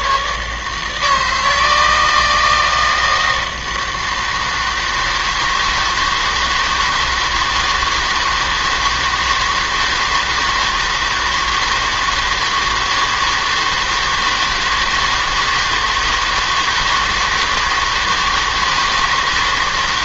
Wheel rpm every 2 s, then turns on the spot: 150, 160, 160, 160, 160, 160, 160, 160, 160, 160.
none